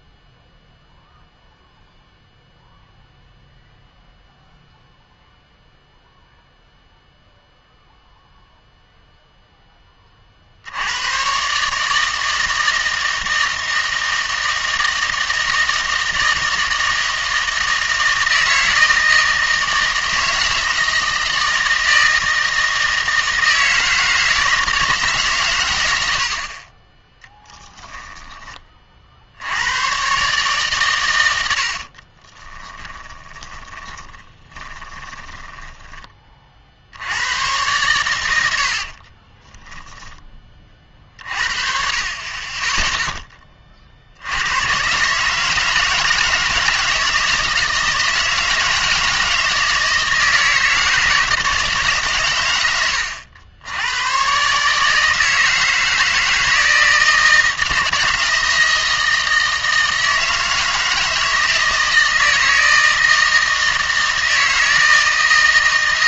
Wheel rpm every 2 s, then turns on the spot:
0, 0, 0, 0, 0, 60, 160, 160, 160, 160, 160, 160, 160, 40, 20, 140, 20, 20, 50, 70, 30, 20, 110, 160, 160, 160, 110, 140, 160, 160, 160, 160, 160.
32-36 38-40